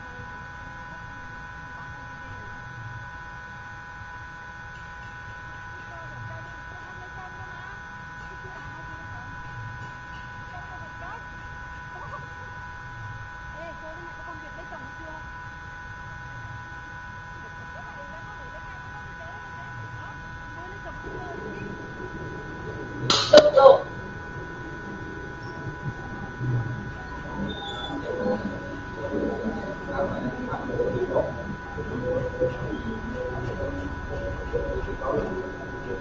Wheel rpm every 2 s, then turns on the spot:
0, 0, 0, 0, 0, 0, 0, 0, 0, 0, 0, 0, 0, 0, 0, 0, 0, 0.
none